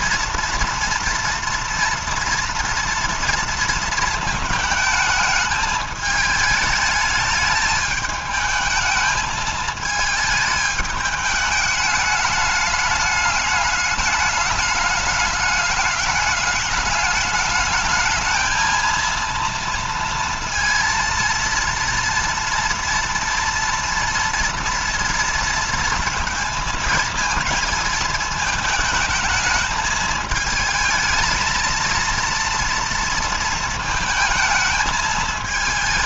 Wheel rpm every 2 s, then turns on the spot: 240, 230, 220, 210, 220, 210, 210, 210, 210, 230, 230, 230, 230, 230, 220, 220, 230, 220.
none